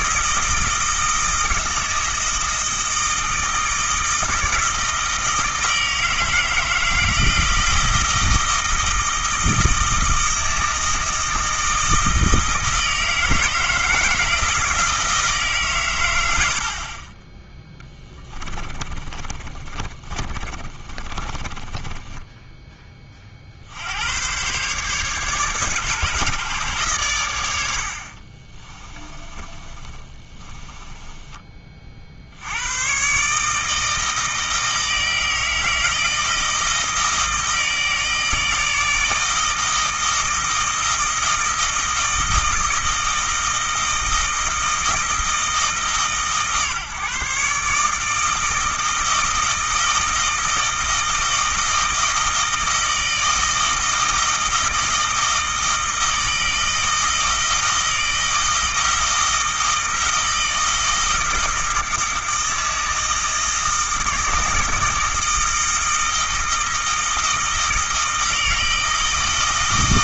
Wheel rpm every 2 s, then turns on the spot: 160, 160, 160, 160, 160, 160, 160, 160, 60, 20, 30, 10, 130, 130, 20, 20, 110, 160, 160, 160, 160, 160, 160, 140, 160, 160, 160, 160, 160, 160, 160, 160, 160, 160, 160.
18-22 28-32